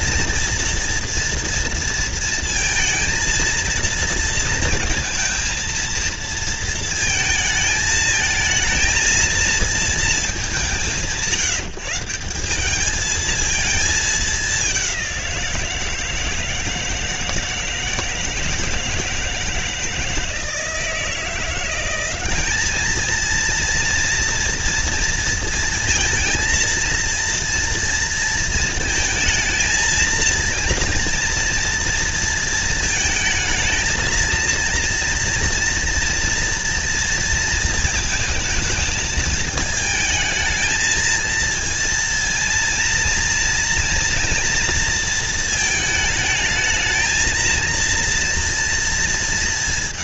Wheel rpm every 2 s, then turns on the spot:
230, 230, 230, 230, 220, 160, 190, 200, 160, 160, 160, 200, 230, 230, 230, 230, 230, 230, 230, 220, 220, 230, 230, 220, 230.
none